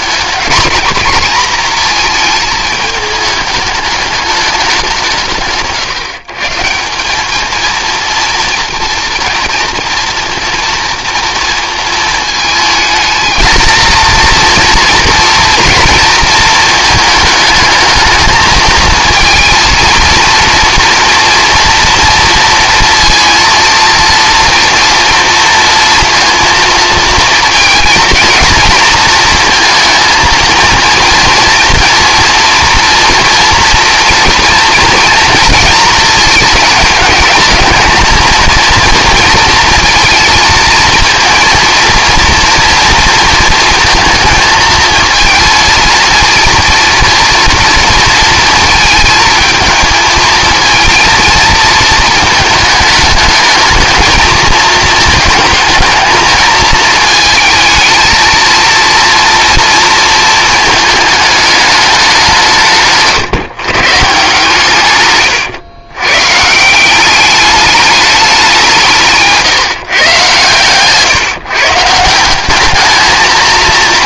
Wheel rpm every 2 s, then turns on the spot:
220, 220, 200, 170, 230, 230, 220, 230, 230, 220, 230, 230, 230, 230, 220, 230, 230, 240, 220, 230, 230, 230, 230, 230, 230, 230, 220, 220, 220, 230, 220, 170, 140, 160, 180, 120, 200.
70-72